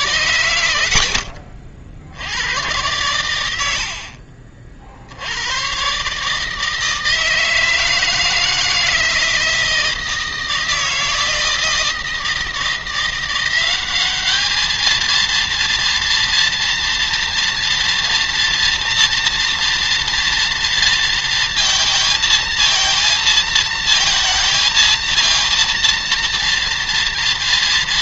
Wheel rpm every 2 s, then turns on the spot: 100, 100, 70, 160, 160, 160, 170, 220, 230, 230, 230, 230, 230, 230.
none